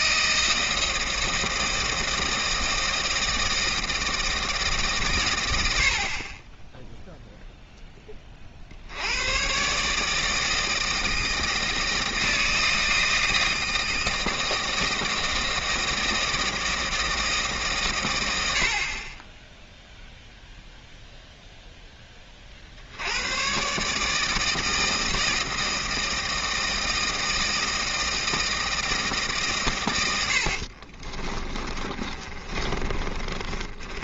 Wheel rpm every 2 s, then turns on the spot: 160, 160, 150, 10, 60, 160, 160, 160, 160, 60, 0, 60, 160, 160, 160, 60, 30.
30-34